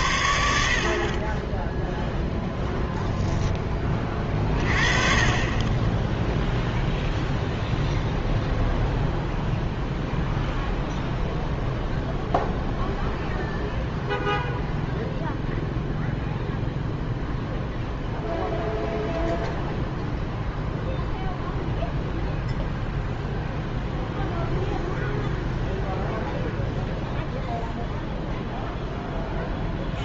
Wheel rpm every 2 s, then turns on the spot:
60, 0, 40, 0, 0, 0, 0, 0, 0, 0, 0, 0, 0, 0, 0.
none